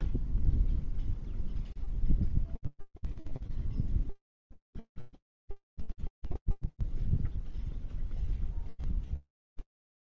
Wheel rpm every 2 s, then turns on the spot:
0, 0, 0, 0, 0.
none